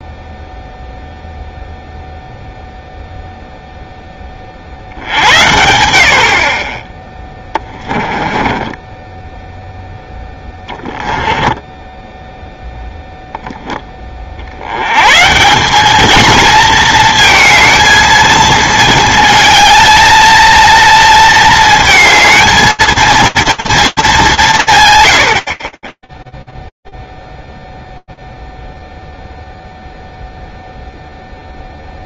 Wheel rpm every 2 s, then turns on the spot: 0, 0, 20, 80, 20, 10, 0, 50, 220, 220, 230, 220, 160, 0, 0, 0.
8-12